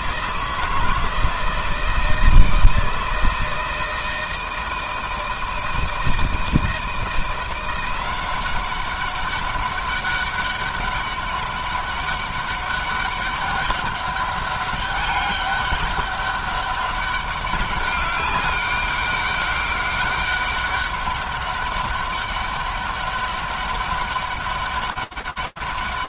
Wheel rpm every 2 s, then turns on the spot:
160, 160, 160, 160, 190, 200, 200, 200, 200, 200, 200, 200, 200.
none